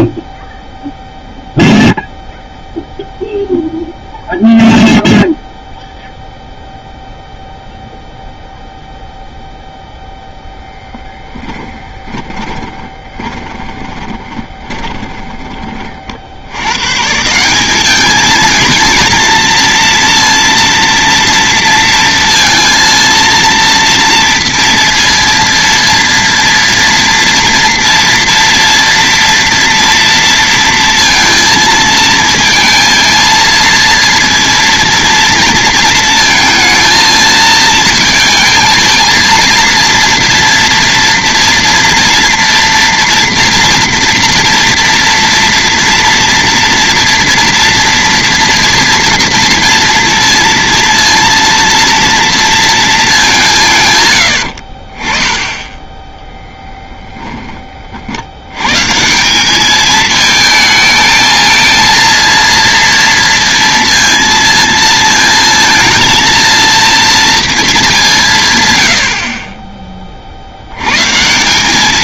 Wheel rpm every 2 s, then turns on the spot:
0, 0, 0, 0, 0, 0, 20, 20, 100, 220, 230, 230, 230, 230, 230, 230, 230, 230, 220, 230, 230, 230, 230, 230, 230, 230, 230, 60, 0, 110, 220, 230, 230, 230, 140, 80.
12-16 54-56